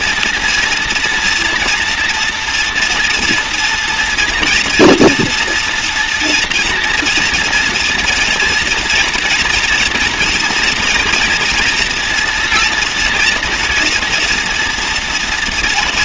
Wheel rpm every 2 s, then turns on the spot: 240, 240, 230, 230, 230, 230, 230, 240.
none